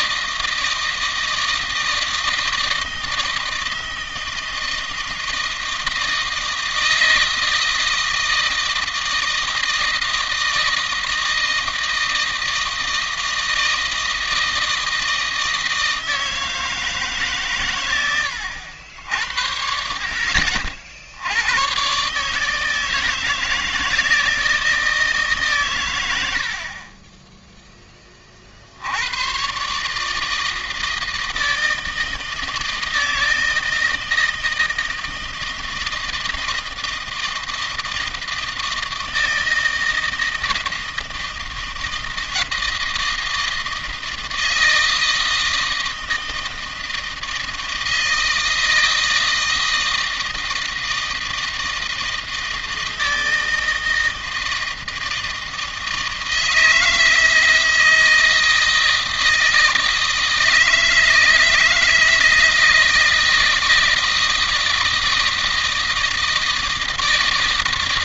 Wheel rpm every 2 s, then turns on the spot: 160, 160, 160, 160, 160, 160, 160, 160, 160, 70, 70, 160, 150, 30, 90, 160, 160, 160, 160, 160, 160, 160, 160, 160, 160, 160, 160, 160, 160, 160, 160, 160, 160, 160.
none